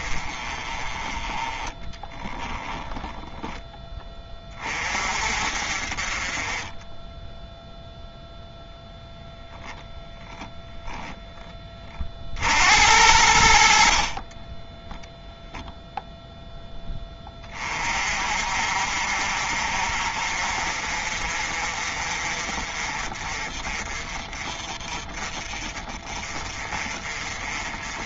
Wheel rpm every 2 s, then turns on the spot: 20, 30, 40, 10, 0, 10, 80, 10, 10, 50, 40, 40, 40, 40.
2-4 6-8 14-16